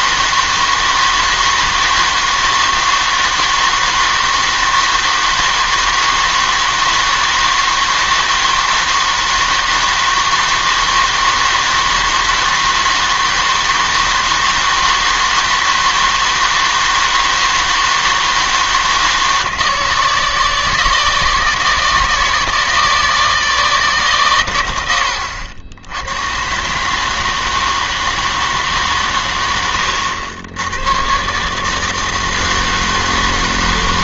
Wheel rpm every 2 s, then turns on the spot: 160, 160, 160, 160, 160, 160, 160, 160, 160, 160, 160, 160, 90, 140, 150, 100, 160.
none